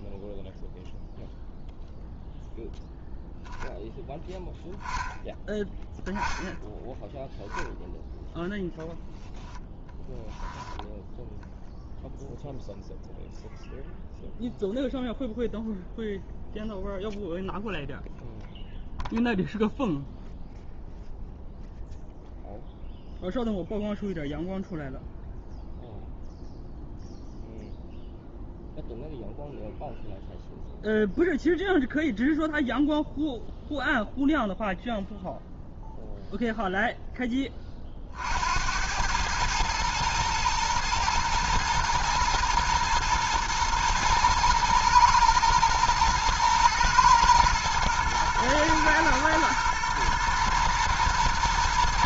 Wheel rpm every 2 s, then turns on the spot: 0, 0, 10, 0, 10, 0, 0, 0, 0, 0, 0, 0, 0, 0, 0, 0, 0, 0, 0, 80, 120, 110, 110, 110, 120, 120.
none